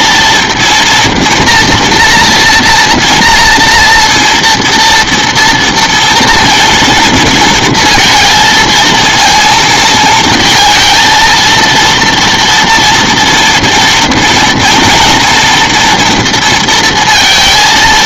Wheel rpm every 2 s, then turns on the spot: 230, 230, 240, 230, 230, 230, 230, 230, 230.
none